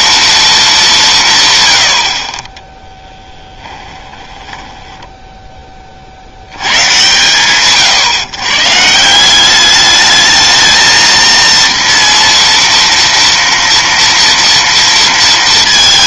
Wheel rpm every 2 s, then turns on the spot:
230, 40, 10, 110, 130, 220, 230, 230.
4-6